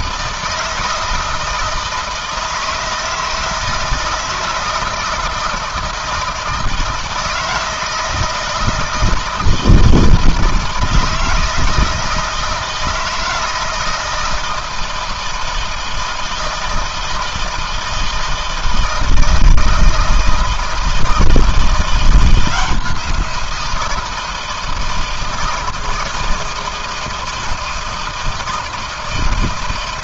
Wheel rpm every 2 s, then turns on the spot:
160, 160, 160, 160, 160, 160, 160, 170, 160, 160, 160, 170, 160, 170, 160.
none